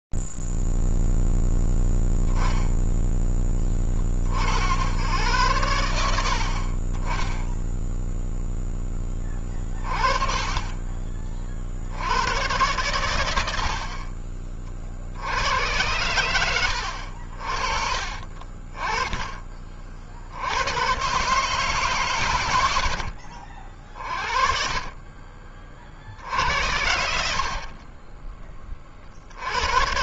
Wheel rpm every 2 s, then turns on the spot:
0, 10, 40, 80, 0, 30, 110, 50, 100, 20, 90, 90, 40, 70, 40.
26-28